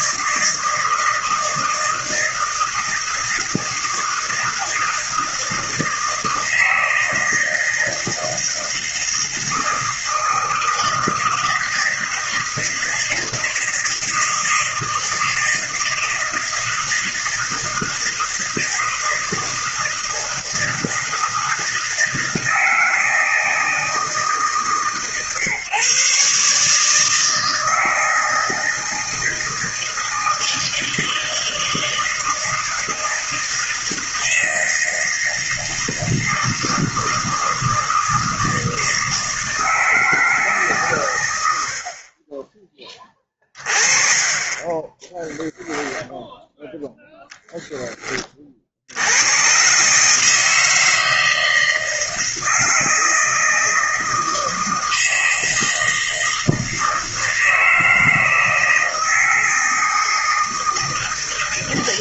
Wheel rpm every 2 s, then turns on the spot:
160, 160, 160, 160, 160, 160, 160, 160, 160, 160, 160, 160, 150, 140, 160, 160, 160, 160, 160, 160, 160, 30, 30, 0, 40, 150, 160, 160, 160, 160, 160.
none